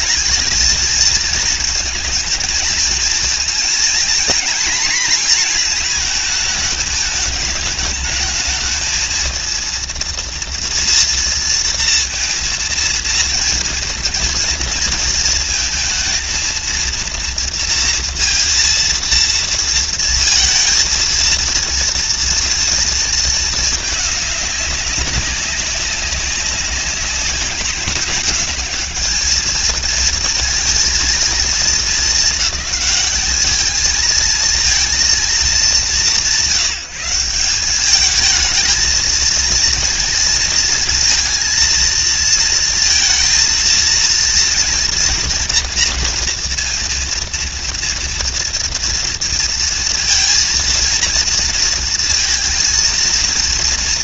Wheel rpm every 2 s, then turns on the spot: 230, 230, 240, 220, 220, 230, 230, 230, 230, 230, 230, 230, 200, 200, 230, 230, 200, 210, 180, 230, 230, 230, 240, 230, 230, 230, 230.
none